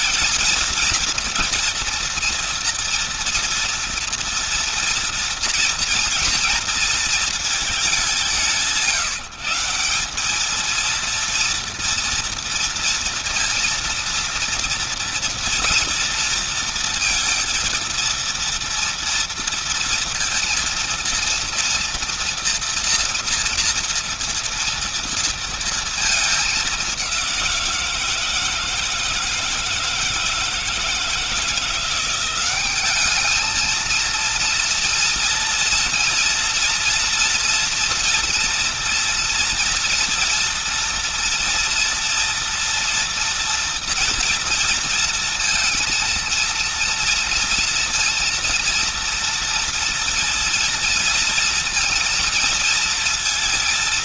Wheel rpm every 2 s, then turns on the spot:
230, 230, 230, 230, 180, 220, 230, 230, 230, 230, 230, 230, 230, 200, 160, 160, 190, 230, 230, 230, 230, 230, 230, 230, 230, 230, 230.
none